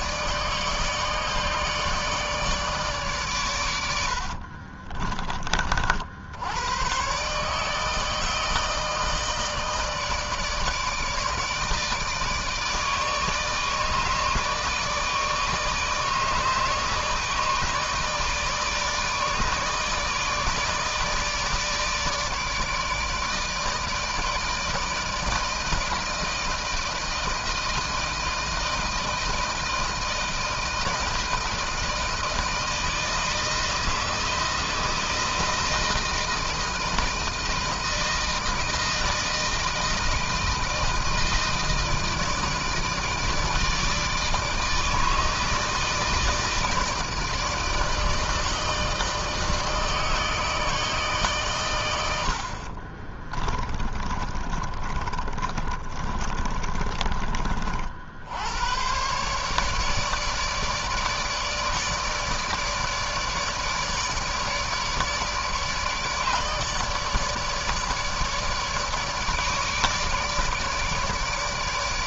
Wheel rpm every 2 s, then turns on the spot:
150, 150, 50, 90, 160, 150, 160, 150, 150, 160, 160, 160, 160, 160, 160, 160, 160, 160, 160, 160, 160, 160, 160, 160, 160, 150, 70, 50, 30, 90, 150, 150, 150, 150, 150, 150.
4-6 52-58